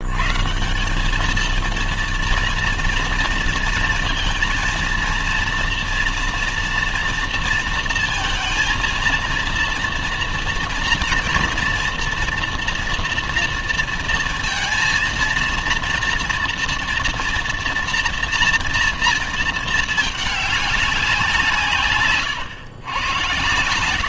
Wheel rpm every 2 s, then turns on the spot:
150, 230, 230, 230, 230, 230, 230, 230, 230, 230, 210, 130.
none